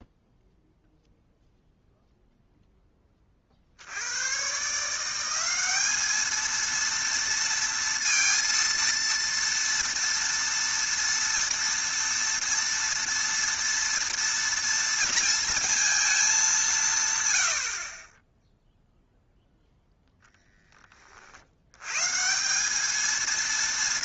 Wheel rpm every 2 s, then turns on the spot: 0, 0, 140, 230, 230, 230, 230, 240, 190, 0, 10, 190.
none